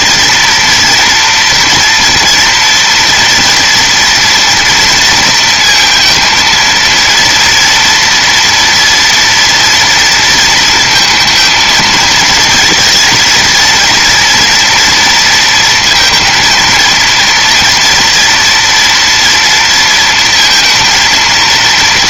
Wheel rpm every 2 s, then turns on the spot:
230, 230, 230, 230, 230, 230, 220, 230, 230, 230, 230.
none